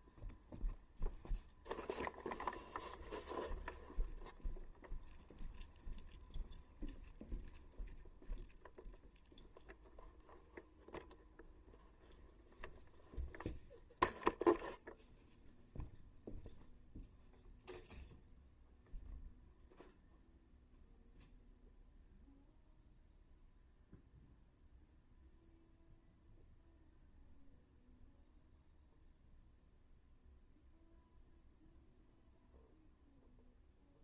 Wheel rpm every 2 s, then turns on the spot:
0, 0, 0, 0, 0, 0, 0, 0, 0, 0, 0, 0, 0, 0, 0, 0, 0.
none